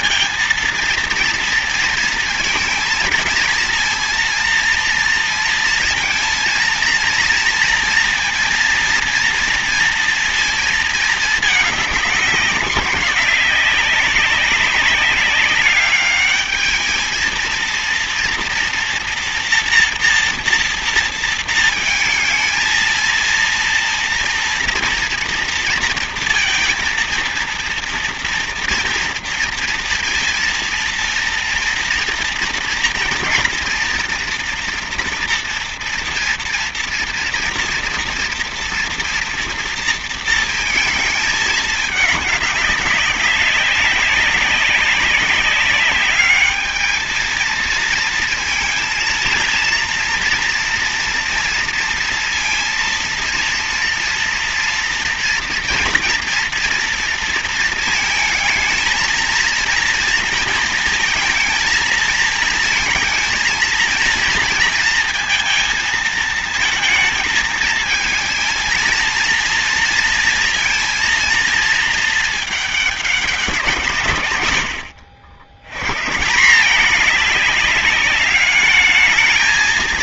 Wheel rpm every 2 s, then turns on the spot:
230, 230, 230, 230, 230, 230, 190, 190, 210, 230, 230, 230, 230, 230, 230, 230, 230, 230, 230, 230, 220, 210, 190, 220, 230, 230, 230, 230, 230, 220, 230, 230, 230, 230, 230, 230, 220, 110, 180, 210.
none